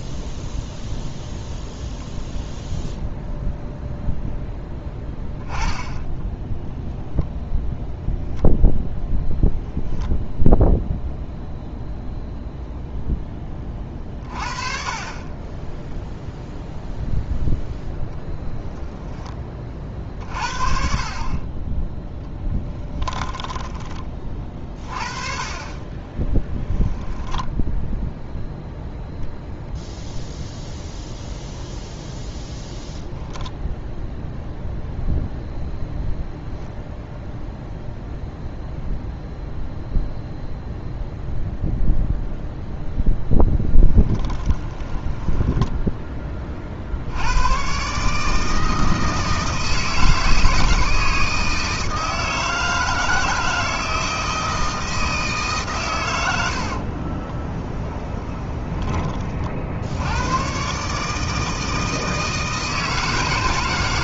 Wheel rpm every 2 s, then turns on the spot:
0, 0, 10, 0, 0, 0, 0, 40, 0, 10, 40, 10, 40, 10, 0, 0, 20, 0, 0, 0, 0, 0, 10, 50, 160, 160, 160, 160, 60, 20, 140, 160.
22-24 26-28 44-46 56-58